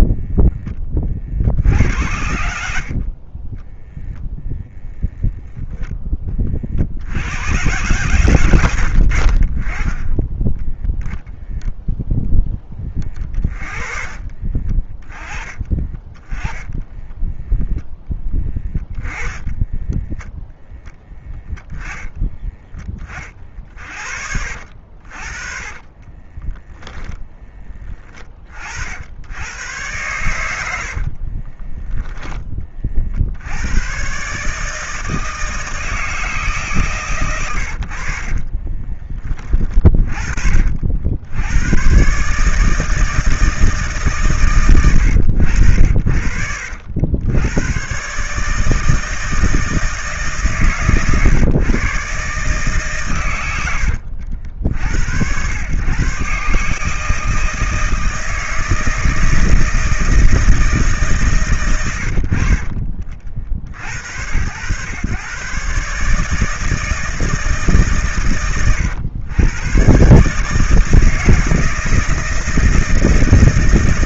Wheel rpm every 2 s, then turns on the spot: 20, 70, 10, 40, 110, 10, 20, 40, 10, 20, 10, 30, 50, 10, 50, 80, 30, 150, 140, 30, 60, 150, 120, 80, 150, 140, 140, 80, 150, 160, 150, 40, 110, 160, 120, 160, 160.
2-4 8-10 14-16 18-20 26-28 38-40